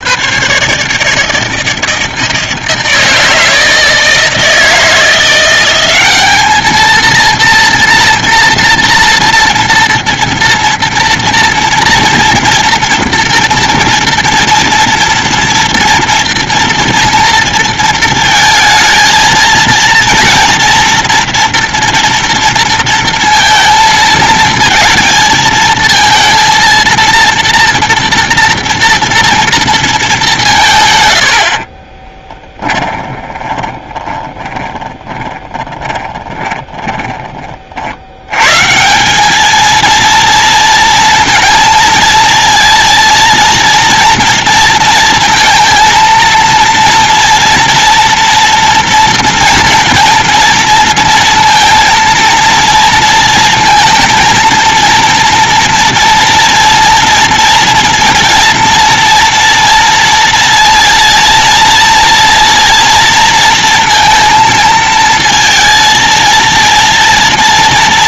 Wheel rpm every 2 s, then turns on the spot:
150, 160, 170, 230, 230, 230, 230, 230, 230, 220, 230, 230, 220, 230, 230, 120, 20, 10, 20, 170, 230, 230, 230, 240, 230, 230, 230, 230, 230, 230, 230, 240, 220, 230.
32-36